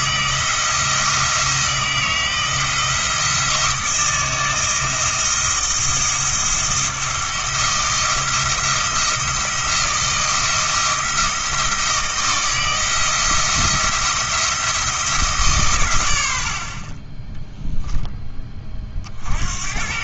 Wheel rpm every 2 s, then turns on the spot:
160, 160, 160, 170, 170, 160, 170, 170, 40, 40.
none